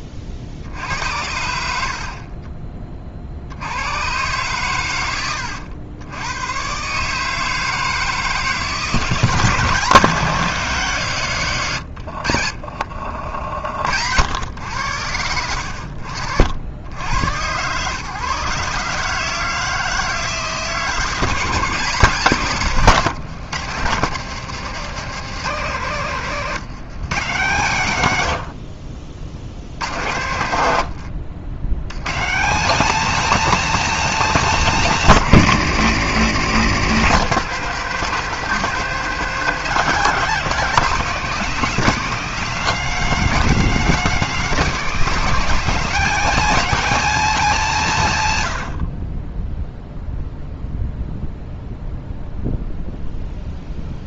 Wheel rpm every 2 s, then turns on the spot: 60, 30, 120, 120, 160, 150, 60, 100, 90, 140, 160, 150, 170, 140, 60, 90, 170, 180, 120, 210, 200, 210, 200, 210, 80, 0, 0.
12-14 30-32